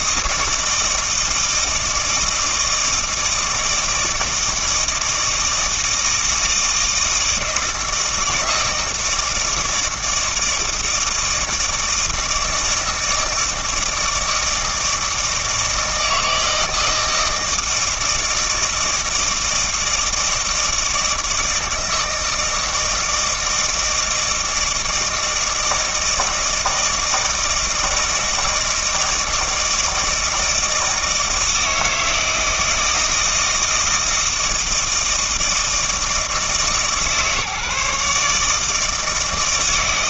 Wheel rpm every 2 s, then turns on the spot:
160, 160, 160, 160, 160, 160, 160, 160, 160, 160, 160, 160, 160, 160, 160, 160, 160, 160, 150, 150.
none